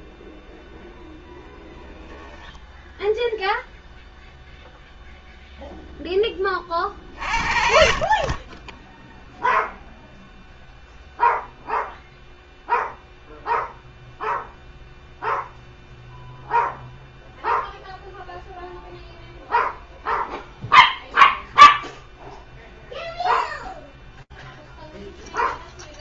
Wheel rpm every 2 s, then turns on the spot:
0, 0, 0, 30, 20, 0, 0, 0, 0, 0, 0, 0, 0.
none